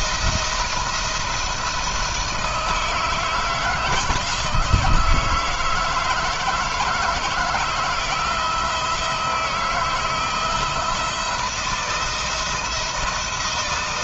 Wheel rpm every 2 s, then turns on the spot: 170, 160, 160, 160, 160, 170, 160.
none